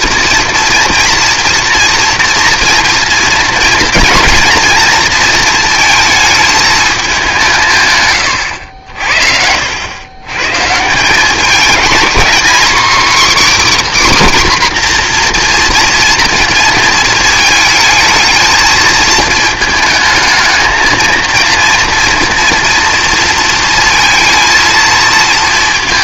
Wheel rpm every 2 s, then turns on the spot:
230, 230, 230, 220, 100, 130, 260, 280, 230, 220, 220, 230, 230.
8-10